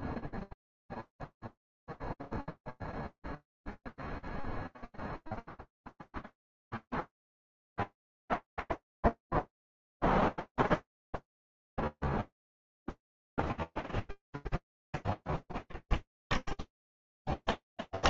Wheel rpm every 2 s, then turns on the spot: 0, 0, 0, 0, 0, 0, 0, 0, 20.
16-18